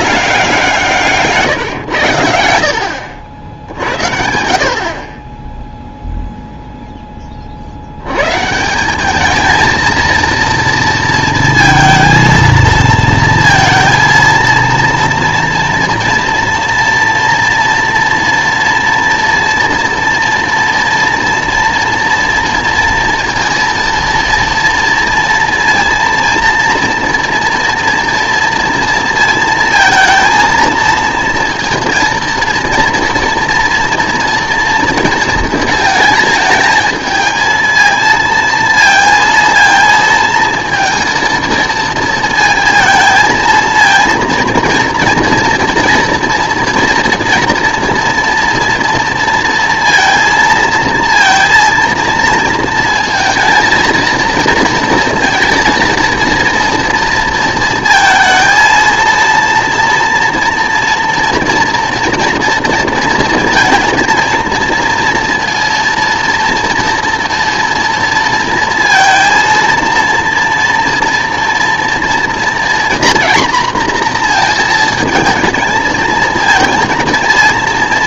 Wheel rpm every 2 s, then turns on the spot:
180, 90, 60, 0, 160, 230, 220, 230, 230, 230, 230, 230, 230, 230, 230, 230, 230, 230, 220, 230, 230, 230, 240, 230, 230, 230, 230, 230, 230, 220, 230, 230, 230, 230, 230, 230, 230, 230, 230.
none